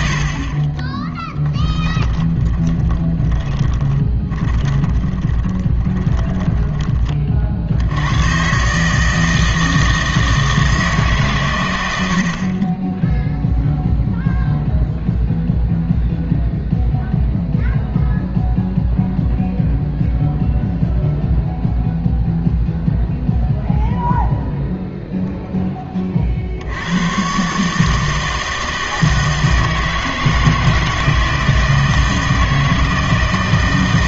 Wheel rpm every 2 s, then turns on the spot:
20, 10, 30, 20, 140, 160, 30, 0, 0, 0, 0, 0, 0, 80, 160, 160, 160.
2-8